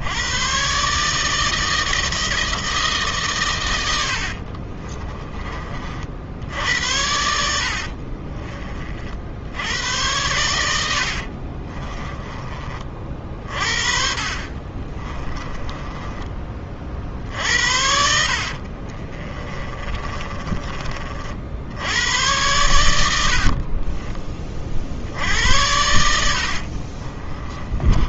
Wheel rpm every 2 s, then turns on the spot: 140, 150, 40, 80, 40, 80, 40, 30, 40, 40, 40, 90, 60, 50.
4-6 10-12 14-16 18-20 26-28